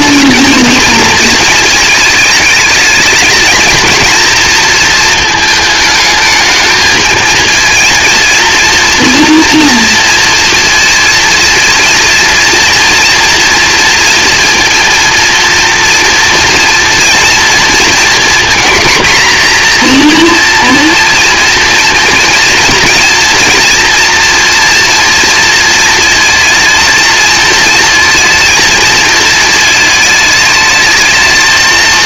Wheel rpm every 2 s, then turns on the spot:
230, 220, 230, 220, 230, 230, 230, 230, 240, 240, 240, 240, 230, 220, 220, 220.
none